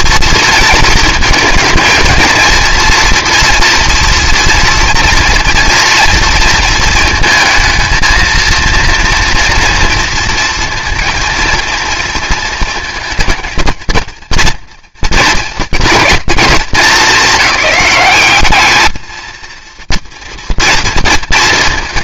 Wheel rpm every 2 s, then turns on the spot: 230, 220, 230, 230, 230, 230, 230, 230, 220, 210, 230.
none